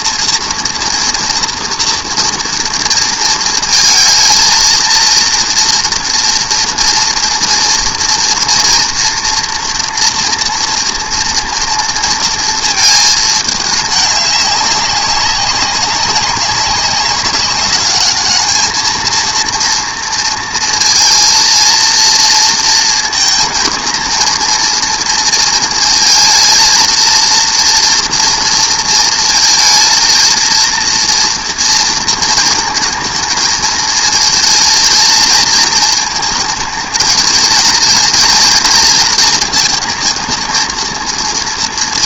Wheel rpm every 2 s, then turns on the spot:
230, 230, 230, 230, 230, 240, 230, 200, 190, 220, 230, 230, 230, 230, 230, 230, 220, 230, 230, 230, 230.
none